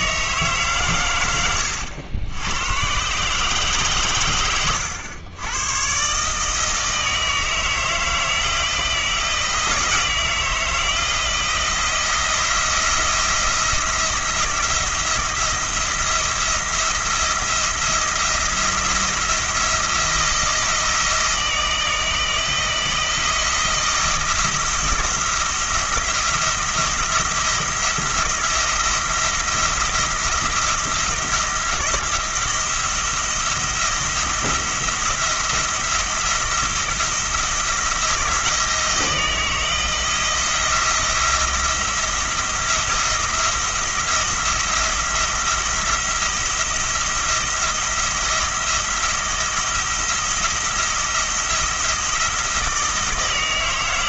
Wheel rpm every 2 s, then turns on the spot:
140, 110, 110, 160, 160, 160, 170, 170, 170, 170, 160, 170, 170, 170, 170, 170, 170, 170, 170, 160, 170, 170, 170, 170, 170, 170, 160.
none